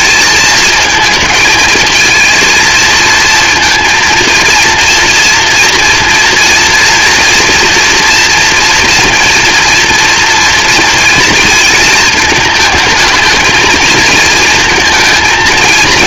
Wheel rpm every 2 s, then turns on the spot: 230, 230, 230, 240, 230, 230, 220, 230.
none